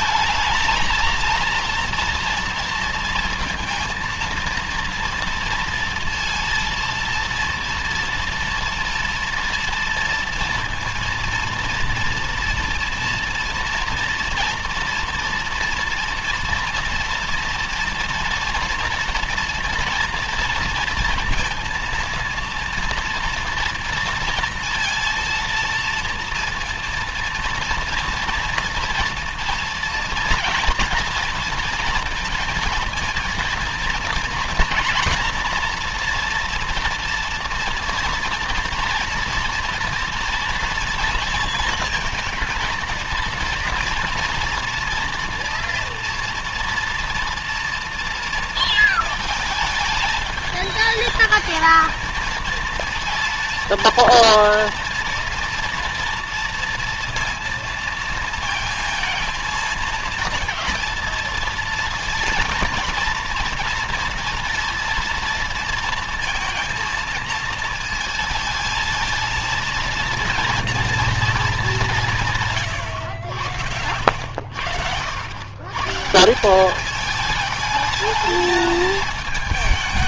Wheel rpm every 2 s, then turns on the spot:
220, 230, 230, 230, 230, 230, 230, 230, 230, 230, 240, 230, 230, 230, 230, 230, 230, 230, 230, 240, 230, 230, 230, 230, 230, 220, 230, 230, 230, 230, 230, 230, 230, 230, 220, 230, 130, 80, 190, 220.
none